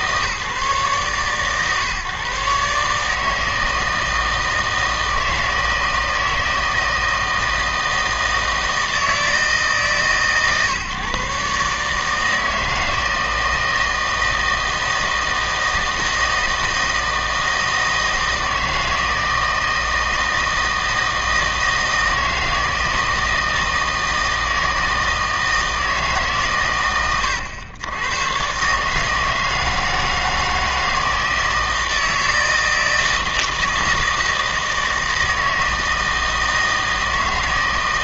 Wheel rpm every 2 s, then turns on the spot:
140, 140, 160, 160, 160, 140, 160, 160, 160, 160, 160, 160, 160, 130, 130, 160, 160, 160, 160.
none